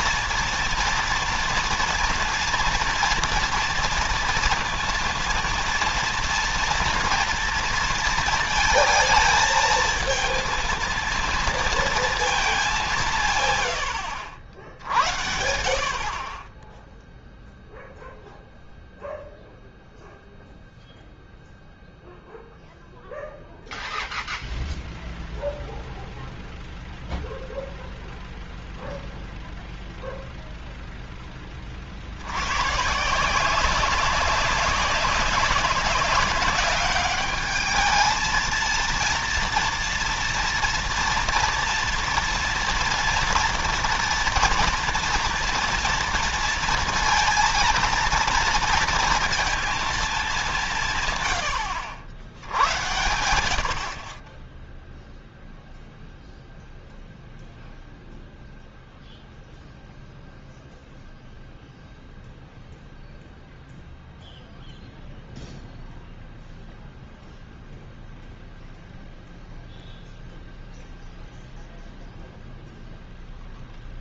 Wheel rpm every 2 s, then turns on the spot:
230, 230, 230, 230, 220, 230, 180, 50, 10, 0, 0, 0, 0, 0, 0, 0, 140, 190, 200, 230, 230, 230, 230, 230, 230, 170, 100, 0, 0, 0, 0, 0, 0, 0, 0, 0, 0.
none